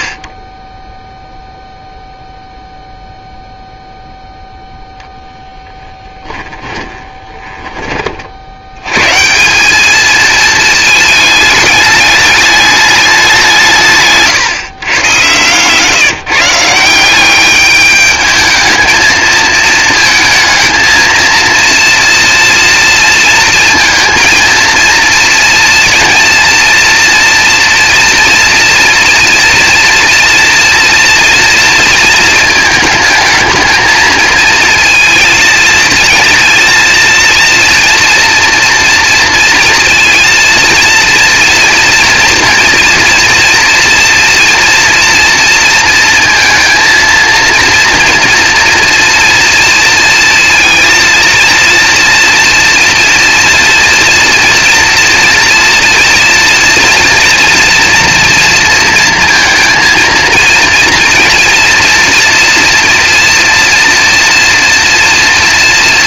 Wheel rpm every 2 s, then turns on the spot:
0, 0, 0, 20, 140, 220, 200, 120, 180, 220, 230, 230, 230, 240, 230, 230, 220, 220, 230, 230, 230, 230, 230, 230, 230, 230, 230, 230, 230, 230, 230, 240, 230.
6-8